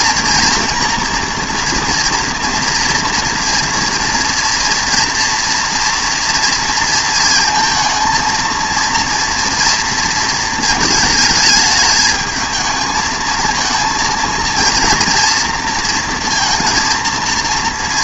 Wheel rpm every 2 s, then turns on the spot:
230, 230, 230, 230, 230, 220, 220, 230, 230.
none